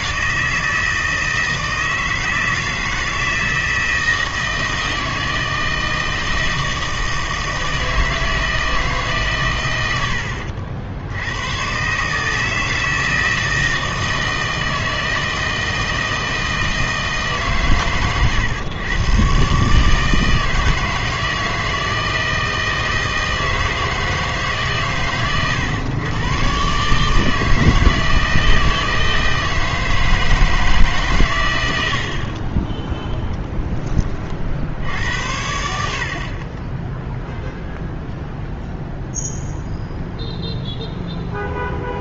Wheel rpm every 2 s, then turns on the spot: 160, 160, 160, 160, 160, 70, 160, 160, 160, 110, 160, 160, 140, 140, 160, 150, 20, 70, 20, 0, 0.
32-34